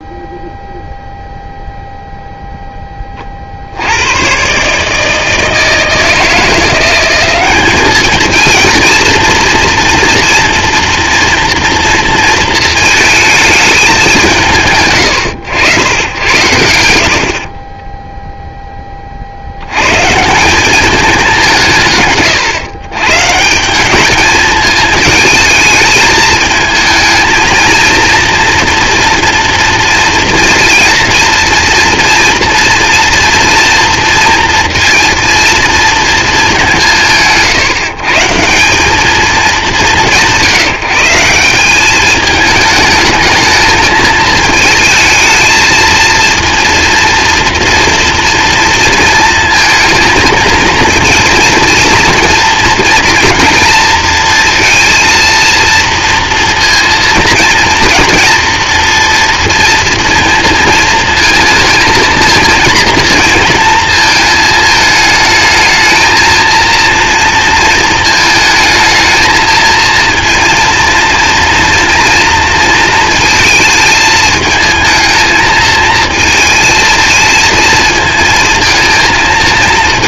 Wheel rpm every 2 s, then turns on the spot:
0, 0, 140, 170, 230, 230, 230, 160, 80, 10, 190, 120, 220, 220, 230, 230, 240, 230, 190, 180, 170, 210, 220, 230, 230, 230, 230, 230, 230, 230, 220, 230, 220, 230, 220, 230, 230, 220, 230, 230.
none